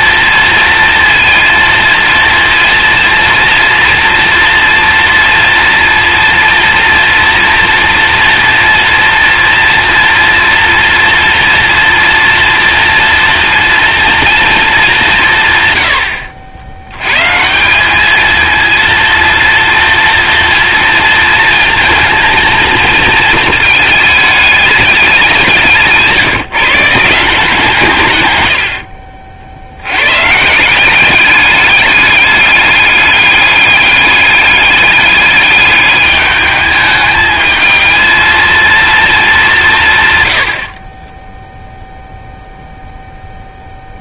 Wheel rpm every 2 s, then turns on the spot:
230, 230, 230, 230, 240, 230, 230, 200, 100, 230, 230, 220, 200, 160, 70, 180, 210, 200, 210, 230, 40, 0.
40-42